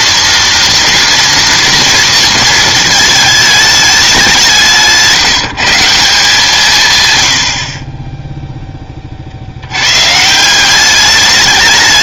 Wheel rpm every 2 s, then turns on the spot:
240, 220, 170, 140, 10, 190.
none